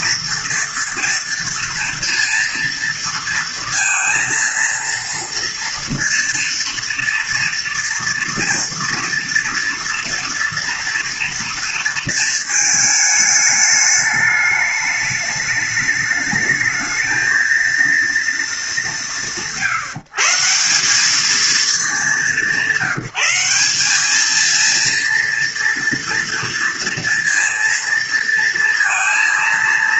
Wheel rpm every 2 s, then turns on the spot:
230, 230, 230, 230, 230, 230, 210, 210, 220, 160, 190, 190, 230, 230, 230.
none